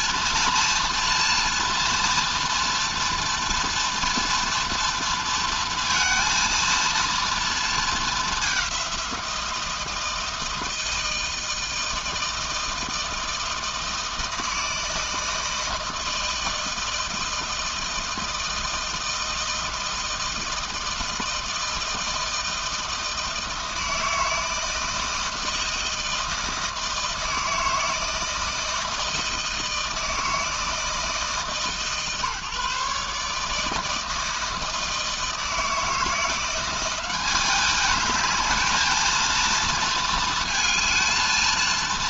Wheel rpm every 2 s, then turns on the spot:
230, 230, 230, 230, 190, 160, 160, 160, 160, 160, 160, 160, 160, 160, 160, 160, 150, 160, 190, 220, 220.
none